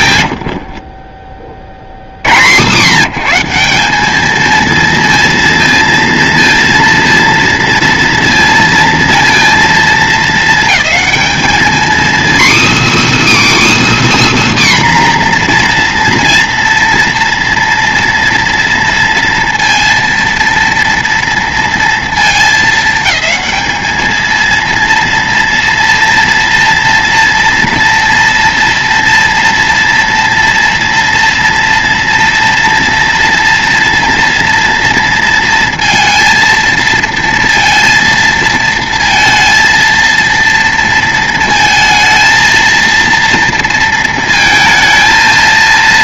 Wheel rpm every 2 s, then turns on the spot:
80, 110, 210, 230, 230, 220, 290, 300, 230, 230, 230, 220, 230, 240, 230, 230, 230, 230, 230, 230, 230, 230, 220.
0-2